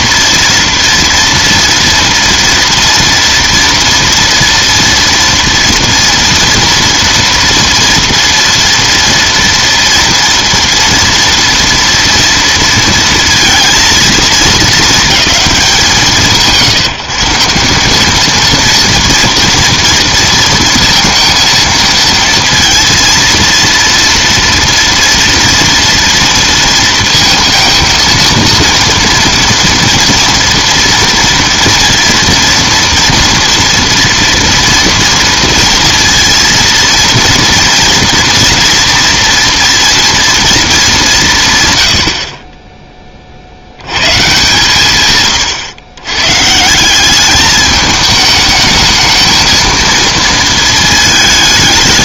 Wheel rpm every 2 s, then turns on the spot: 240, 230, 230, 230, 230, 240, 230, 220, 160, 230, 230, 230, 230, 230, 230, 230, 230, 230, 230, 230, 220, 30, 130, 150, 210, 220.
none